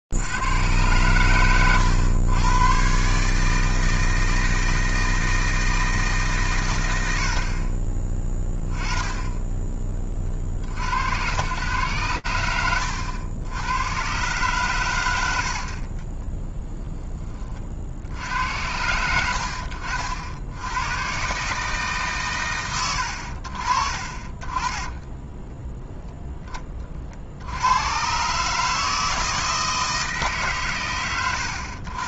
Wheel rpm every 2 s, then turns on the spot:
40, 110, 160, 160, 30, 30, 110, 110, 10, 80, 90, 150, 20, 20, 150, 150.
16-18